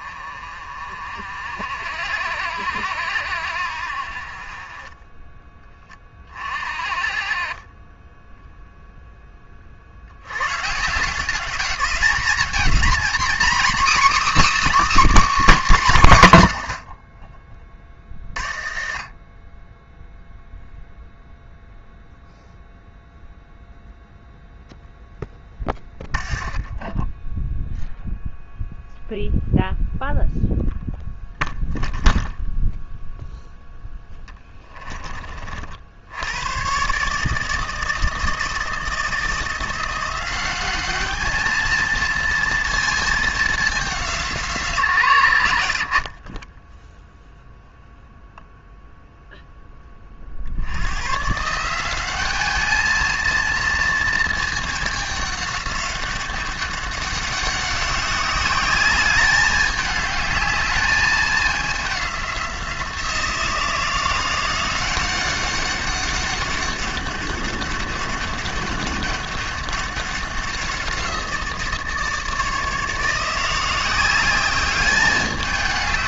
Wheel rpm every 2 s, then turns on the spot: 40, 60, 30, 40, 0, 130, 230, 300, 120, 40, 0, 0, 0, 20, 0, 0, 0, 10, 120, 160, 200, 230, 150, 10, 0, 80, 210, 220, 200, 200, 210, 180, 180, 200, 200, 180, 160, 200.
18-20 26-28